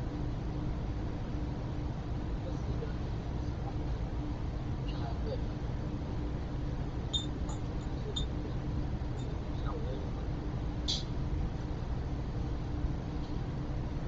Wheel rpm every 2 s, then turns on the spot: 0, 0, 0, 0, 0, 0, 0.
none